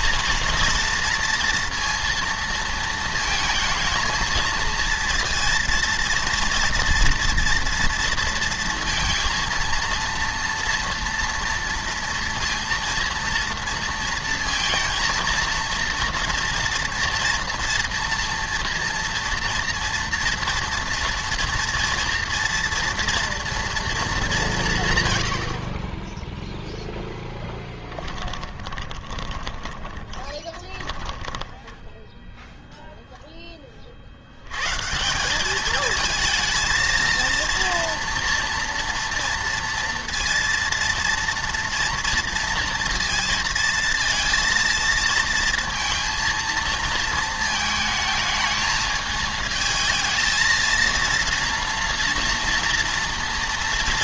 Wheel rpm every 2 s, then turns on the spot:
230, 230, 230, 230, 230, 230, 230, 230, 240, 230, 230, 240, 160, 0, 20, 10, 0, 130, 220, 230, 230, 230, 220, 230, 220, 230, 230.
28-32